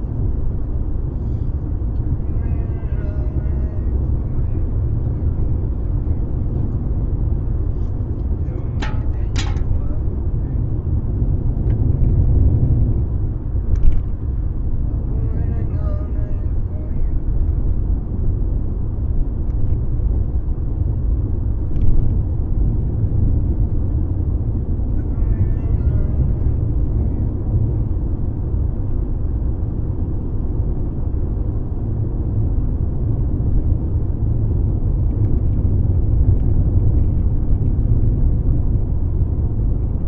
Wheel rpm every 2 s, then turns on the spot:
0, 0, 0, 0, 0, 0, 0, 0, 0, 0, 0, 0, 0, 0, 0, 0, 0, 0, 0, 0.
none